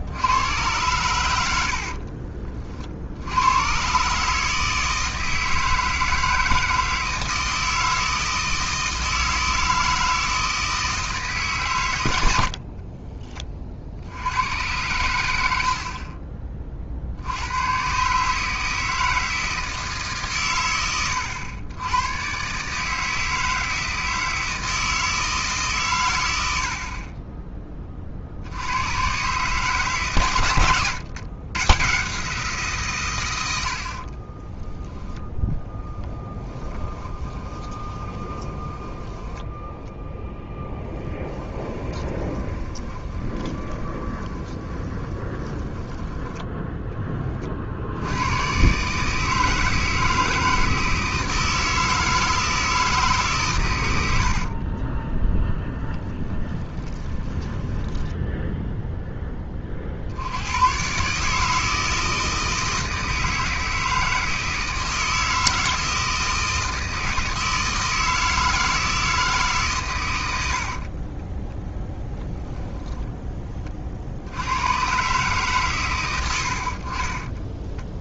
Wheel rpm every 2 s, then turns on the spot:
100, 60, 160, 160, 160, 160, 50, 100, 40, 160, 110, 150, 160, 50, 100, 110, 150, 10, 10, 10, 10, 20, 20, 10, 140, 160, 160, 30, 20, 0, 130, 160, 160, 160, 160, 40, 0, 120, 50.
12-14 26-28 30-32 36-46 54-58 70-72 76-78